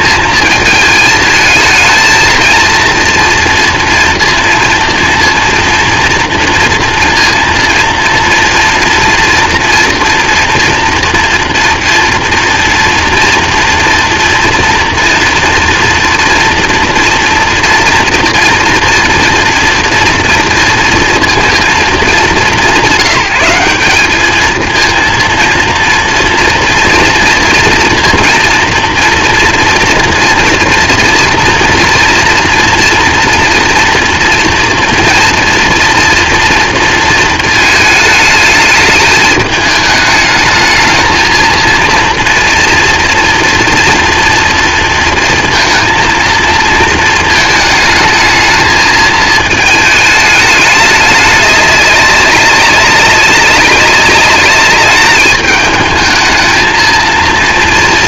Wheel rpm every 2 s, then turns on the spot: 220, 230, 230, 230, 230, 240, 230, 230, 230, 230, 230, 200, 230, 230, 230, 240, 230, 230, 230, 210, 220, 230, 230, 220, 220, 210, 190, 210, 230.
none